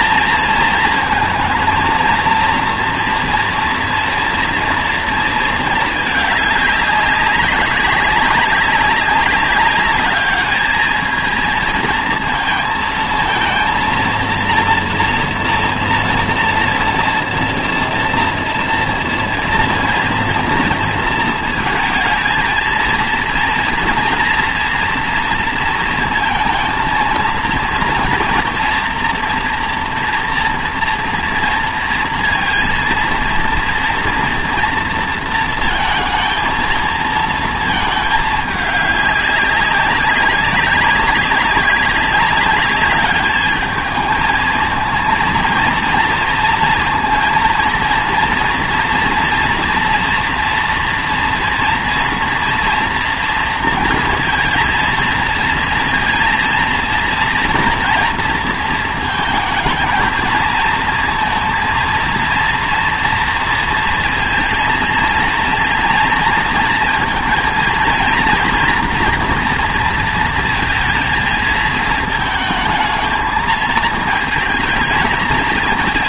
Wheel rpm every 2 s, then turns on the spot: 230, 230, 230, 200, 200, 210, 220, 230, 230, 230, 230, 230, 240, 220, 230, 230, 230, 230, 220, 210, 200, 200, 220, 230, 230, 230, 230, 230, 230, 220, 220, 230, 230, 230, 240, 230, 220, 220.
none